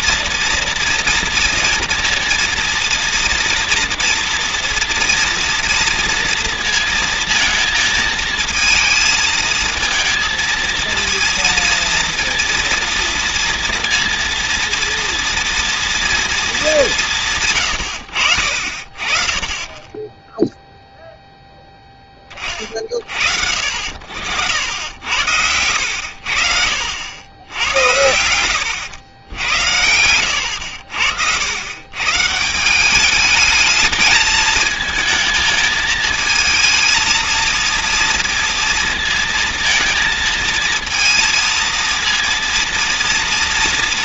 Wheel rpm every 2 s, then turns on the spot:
230, 230, 230, 230, 220, 230, 230, 230, 230, 60, 0, 30, 80, 60, 110, 90, 160, 220, 220, 230, 230, 230.
none